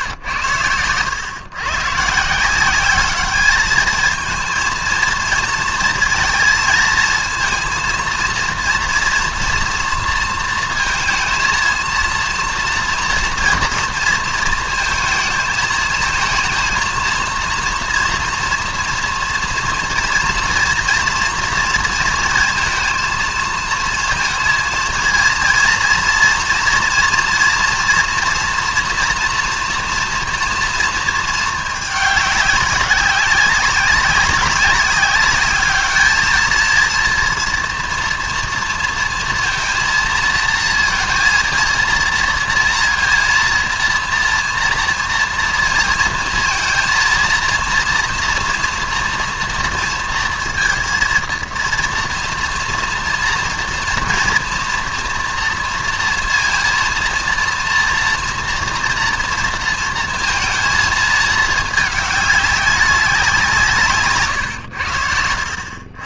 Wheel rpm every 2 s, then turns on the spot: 130, 140, 220, 230, 230, 230, 230, 230, 220, 230, 230, 230, 230, 230, 230, 230, 210, 200, 210, 230, 230, 230, 230, 230, 230, 230, 230, 230, 230, 230, 230, 210, 130.
64-66